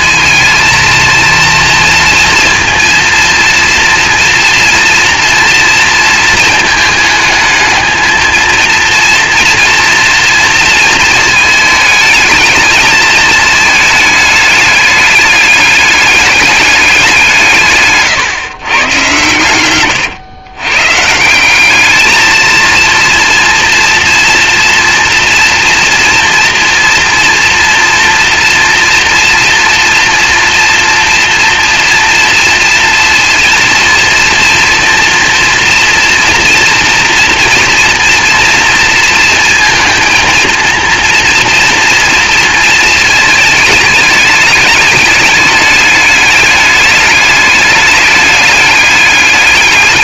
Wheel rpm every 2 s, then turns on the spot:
230, 230, 230, 220, 230, 220, 220, 210, 190, 110, 140, 230, 230, 230, 230, 230, 230, 230, 230, 230, 230, 220, 210, 210, 190.
none